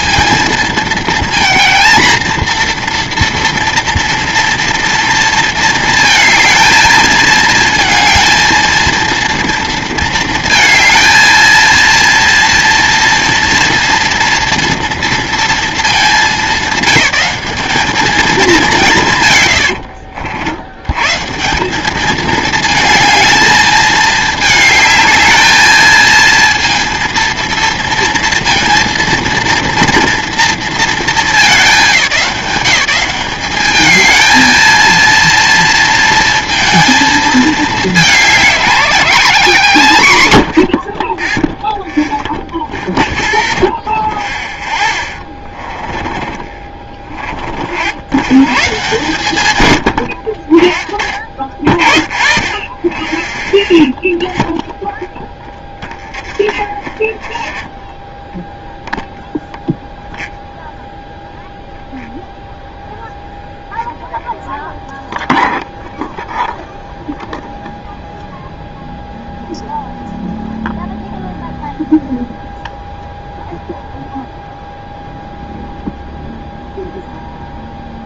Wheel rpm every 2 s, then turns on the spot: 230, 230, 230, 220, 230, 230, 230, 230, 200, 180, 100, 220, 220, 230, 230, 230, 170, 230, 230, 220, 60, 0, 10, 20, 130, 50, 10, 0, 20, 0, 0, 0, 0, 0, 0, 0, 0, 0, 0.
44-48 52-54 56-58